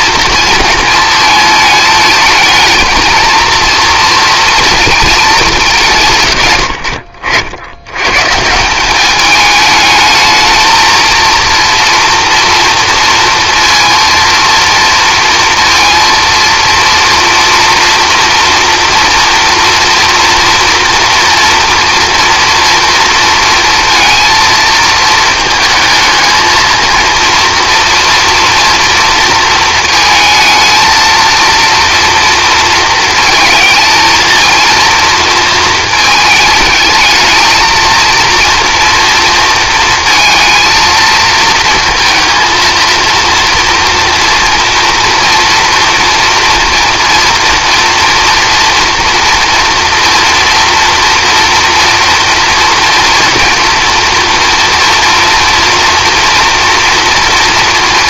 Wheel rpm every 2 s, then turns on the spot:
230, 220, 230, 80, 180, 220, 230, 230, 230, 230, 230, 240, 220, 220, 230, 220, 230, 230, 220, 240, 230, 230, 230, 230, 230, 230, 230, 230, 230.
none